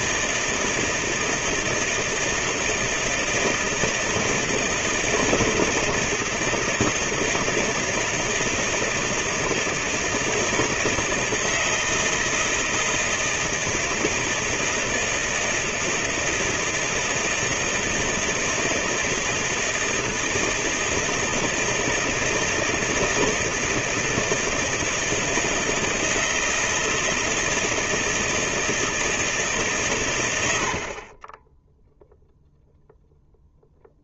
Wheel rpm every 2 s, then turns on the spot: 160, 160, 160, 160, 160, 160, 160, 160, 160, 160, 160, 160, 160, 160, 140, 10, 0.
none